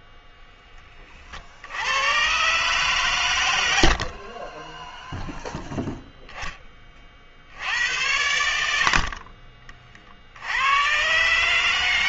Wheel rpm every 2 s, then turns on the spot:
10, 130, 20, 10, 70, 80.
none